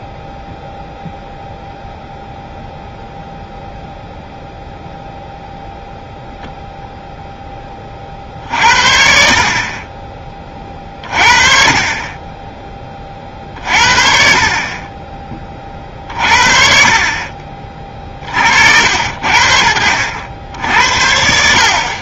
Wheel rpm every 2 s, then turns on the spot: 0, 0, 0, 0, 60, 40, 20, 30, 50, 70, 70.
none